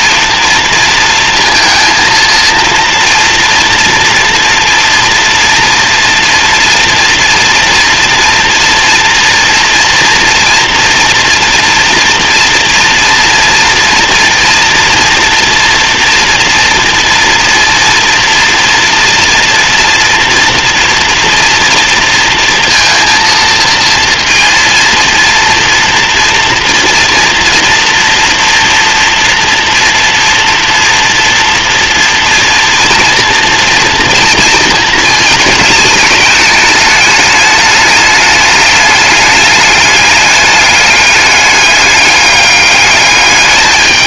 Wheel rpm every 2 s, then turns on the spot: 230, 230, 230, 230, 240, 230, 230, 230, 230, 230, 240, 230, 230, 230, 230, 230, 230, 220, 210, 210, 210, 210.
none